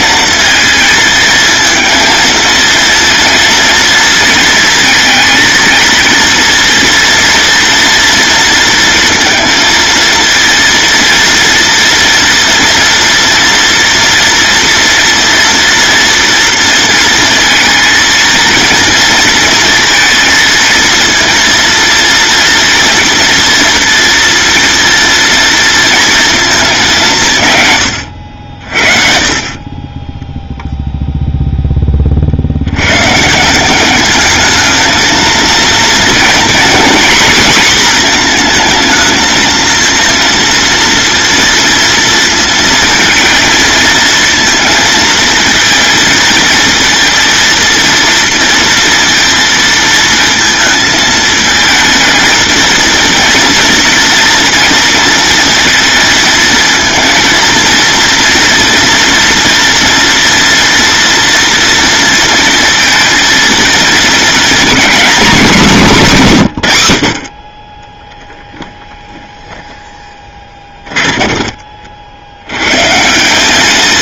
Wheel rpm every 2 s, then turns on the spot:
230, 230, 230, 240, 230, 230, 230, 240, 230, 230, 230, 230, 230, 190, 50, 0, 110, 230, 240, 230, 230, 230, 230, 230, 230, 220, 230, 230, 230, 230, 240, 230, 260, 100, 10, 20, 140.
68-72